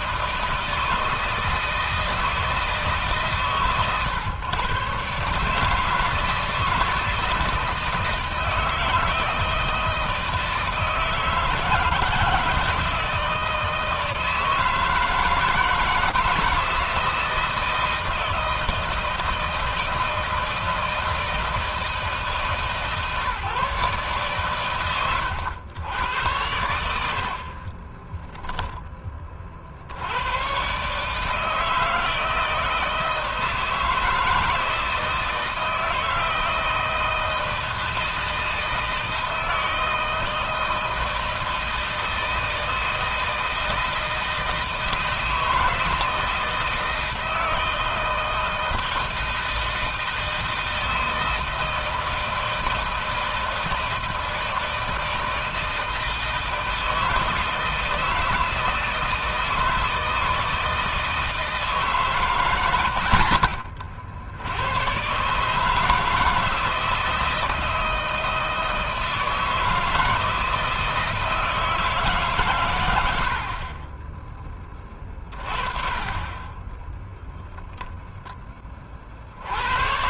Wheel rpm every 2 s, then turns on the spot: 160, 150, 130, 160, 160, 160, 160, 160, 160, 160, 160, 150, 130, 90, 10, 130, 160, 160, 160, 160, 160, 160, 160, 160, 160, 160, 160, 160, 160, 160, 160, 100, 110, 160, 160, 160, 100, 30, 20, 30.
none